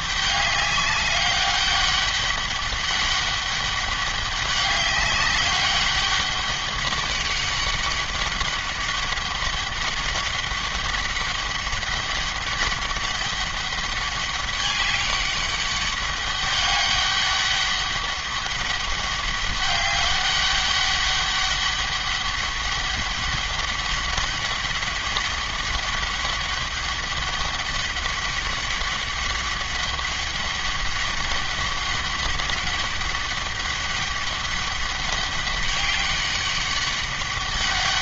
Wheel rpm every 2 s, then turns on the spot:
200, 200, 200, 200, 200, 200, 200, 200, 200, 200, 200, 200, 200, 200, 200, 200, 200, 200, 200.
none